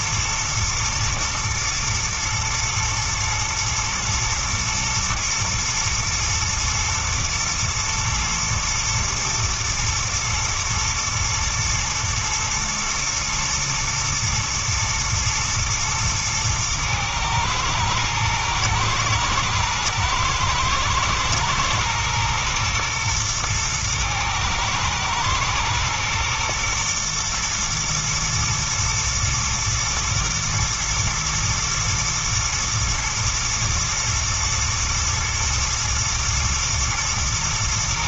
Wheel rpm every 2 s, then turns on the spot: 120, 110, 110, 110, 120, 110, 110, 110, 110, 110, 120, 120, 110, 120, 120, 120, 120, 110, 110.
none